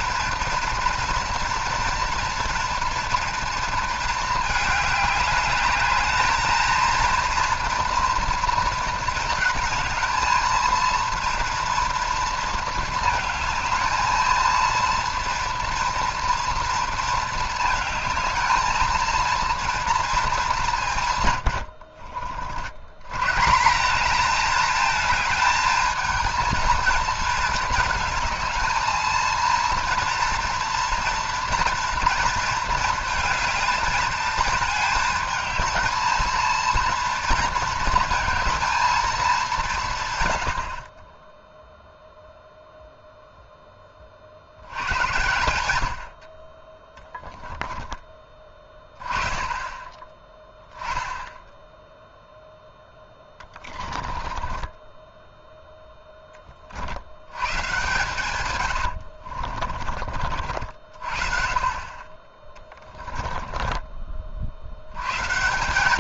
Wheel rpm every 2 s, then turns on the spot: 240, 230, 210, 220, 230, 230, 230, 230, 230, 220, 190, 80, 220, 230, 220, 230, 230, 220, 230, 230, 60, 0, 70, 20, 30, 10, 10, 20, 40, 100, 50, 20, 70.
54-56 58-60